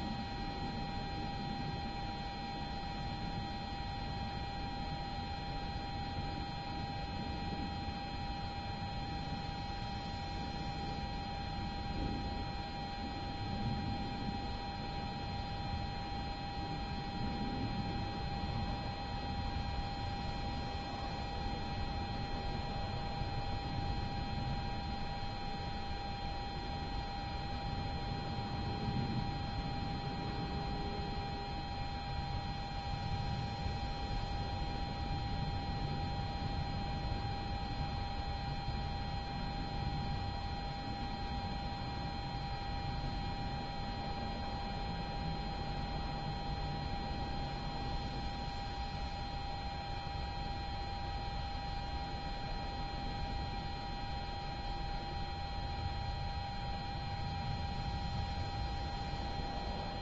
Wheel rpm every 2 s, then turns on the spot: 0, 0, 0, 0, 0, 0, 0, 0, 0, 0, 0, 0, 0, 0, 0, 0, 0, 0, 0, 0, 0, 0, 0, 0, 0, 0, 0, 0, 0, 0.
none